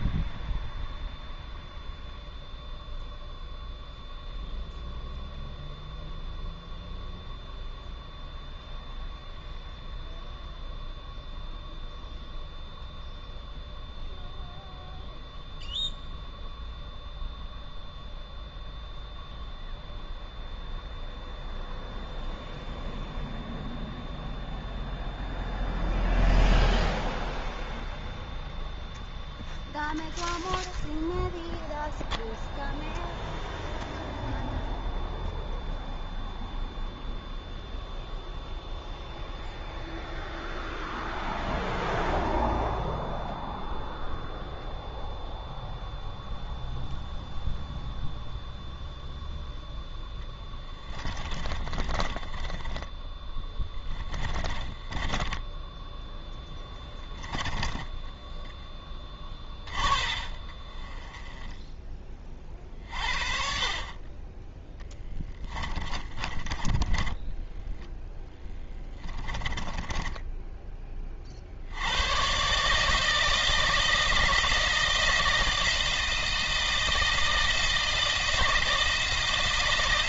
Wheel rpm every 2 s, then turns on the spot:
0, 0, 0, 0, 0, 0, 0, 0, 0, 0, 0, 0, 0, 0, 0, 0, 0, 0, 0, 0, 0, 0, 0, 0, 0, 20, 10, 20, 20, 10, 30, 40, 10, 10, 10, 20, 150, 160, 160, 160.
50-62 64-70